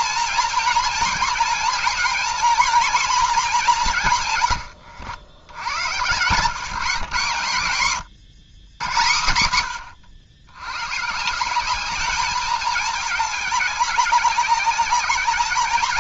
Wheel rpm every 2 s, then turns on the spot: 230, 230, 120, 130, 110, 100, 210, 200.
4-6